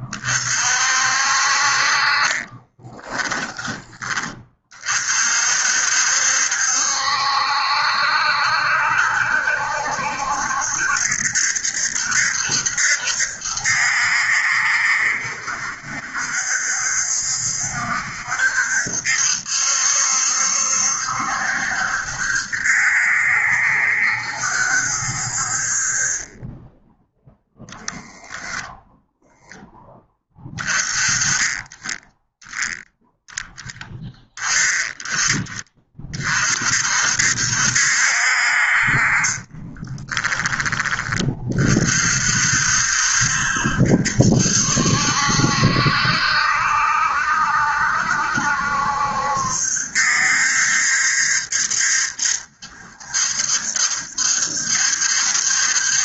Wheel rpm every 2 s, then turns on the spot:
50, 20, 40, 70, 70, 70, 70, 70, 70, 70, 70, 70, 60, 10, 0, 20, 0, 20, 60, 40, 20, 70, 70, 70, 70, 70, 70, 70.
2-4 38-40